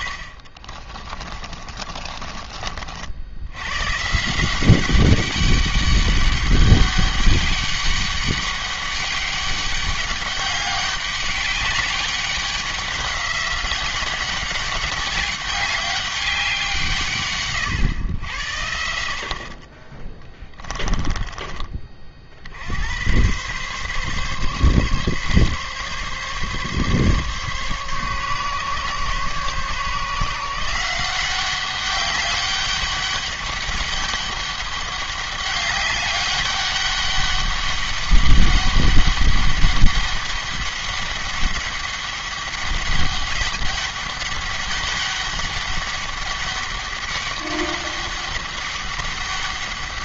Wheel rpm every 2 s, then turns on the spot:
50, 40, 190, 200, 200, 200, 190, 190, 160, 70, 20, 70, 140, 140, 140, 170, 200, 200, 200, 200, 200, 200, 200, 200, 200.
0-2 20-22